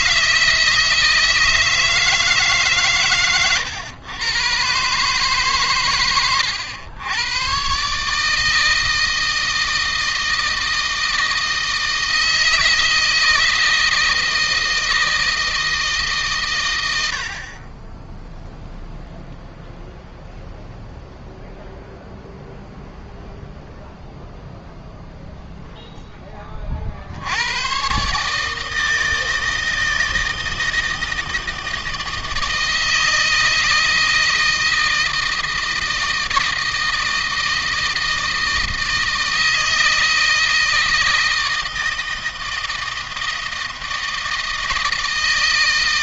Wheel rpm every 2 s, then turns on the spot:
160, 140, 130, 90, 160, 160, 160, 160, 80, 0, 0, 0, 0, 50, 160, 160, 160, 160, 160, 160, 160, 160, 160.
none